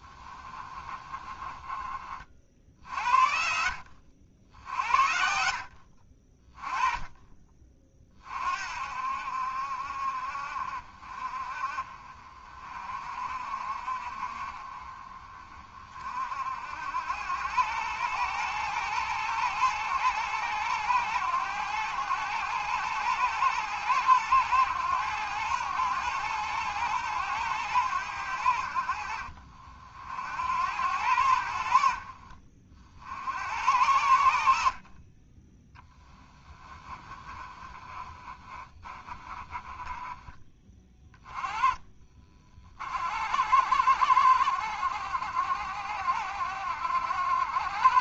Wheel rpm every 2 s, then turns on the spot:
20, 60, 70, 20, 50, 50, 40, 40, 60, 110, 110, 110, 110, 110, 70, 80, 50, 60, 20, 20, 20, 50, 70, 60.
0-2 36-40